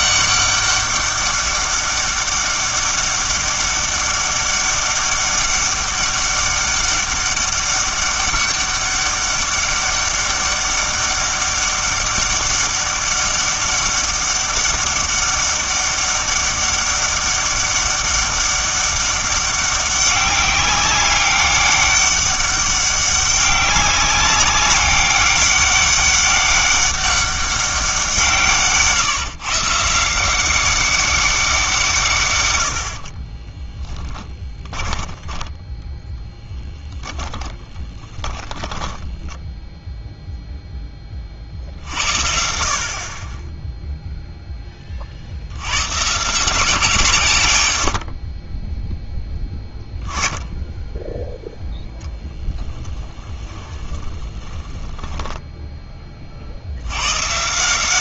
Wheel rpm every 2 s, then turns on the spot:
200, 200, 200, 200, 200, 200, 200, 200, 200, 200, 200, 200, 200, 200, 140, 190, 90, 10, 0, 10, 10, 50, 20, 180, 10, 10, 10, 20, 70.
38-40 52-56